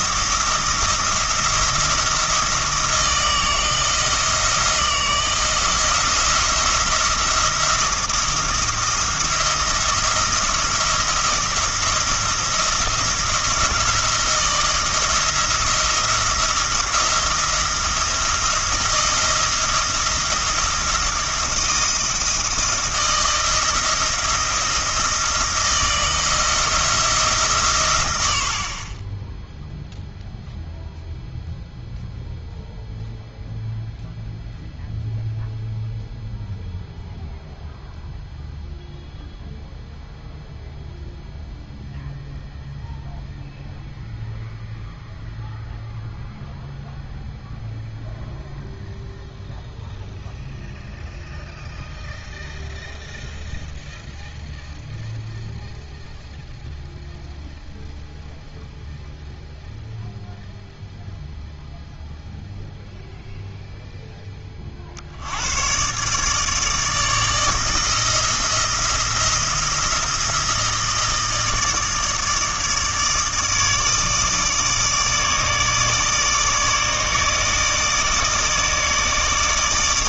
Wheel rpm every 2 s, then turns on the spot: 170, 170, 170, 170, 170, 170, 170, 170, 170, 170, 170, 160, 170, 170, 40, 0, 0, 0, 0, 0, 0, 0, 0, 0, 0, 0, 0, 0, 0, 0, 0, 0, 50, 160, 170, 160, 150, 150, 150, 160.
none